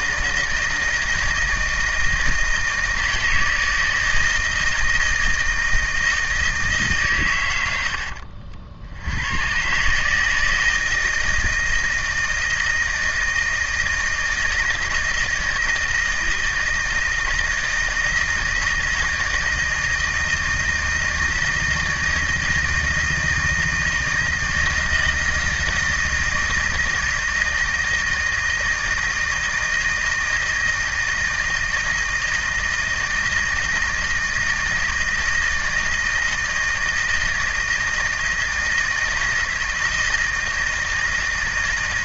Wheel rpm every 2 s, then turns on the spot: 160, 160, 160, 160, 60, 160, 160, 160, 160, 160, 160, 160, 160, 160, 160, 160, 160, 160, 160, 160, 160.
none